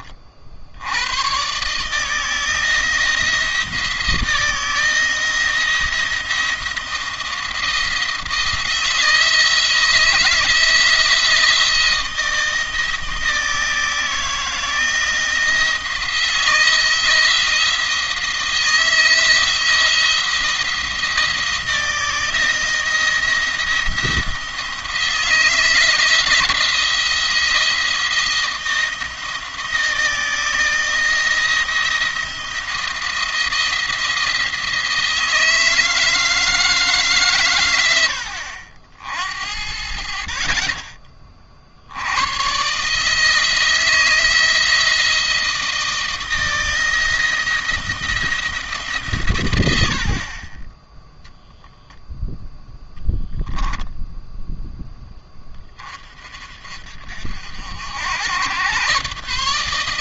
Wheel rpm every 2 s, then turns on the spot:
60, 160, 160, 170, 160, 170, 160, 160, 170, 160, 170, 160, 170, 170, 170, 160, 170, 160, 160, 70, 30, 130, 160, 170, 150, 20, 0, 10, 50, 120.
none